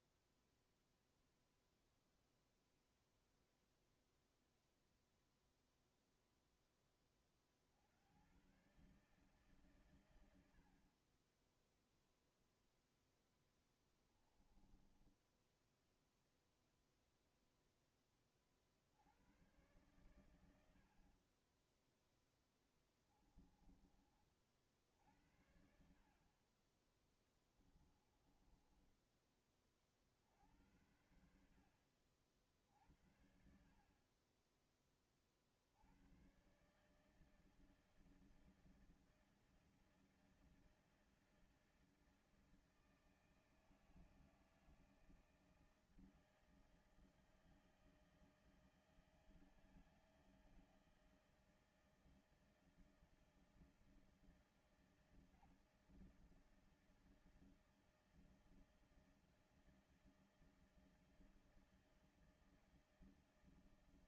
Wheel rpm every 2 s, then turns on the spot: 0, 0, 0, 10, 120, 90, 0, 10, 0, 40, 90, 10, 50, 30, 20, 70, 60, 20, 130, 160, 160, 160, 160, 160, 160, 160, 160, 160, 160, 160, 160, 160.
14-16 20-24